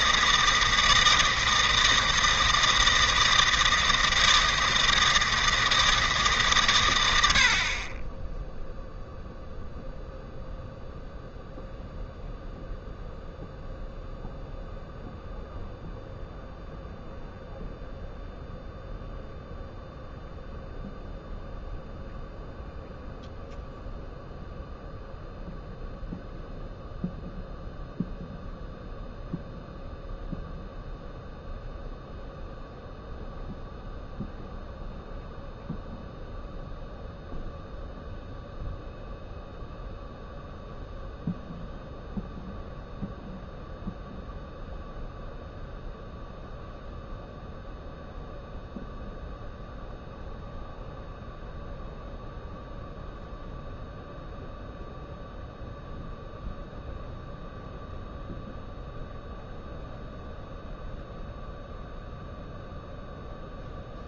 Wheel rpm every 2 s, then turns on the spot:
160, 160, 160, 120, 0, 0, 0, 0, 0, 0, 0, 0, 0, 0, 0, 0, 0, 0, 0, 0, 0, 0, 0, 0, 0, 0, 0, 0, 0, 0, 0, 0.
none